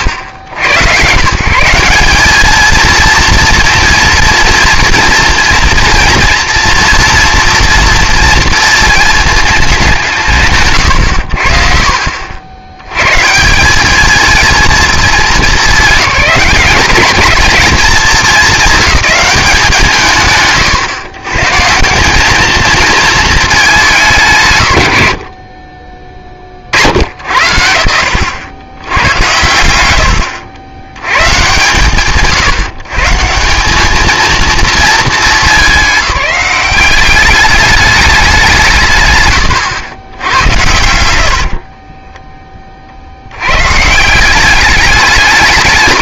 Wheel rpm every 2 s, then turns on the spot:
110, 220, 240, 230, 230, 80, 90, 210, 200, 210, 90, 220, 100, 50, 90, 120, 160, 230, 200, 160, 90, 20, 200.
40-42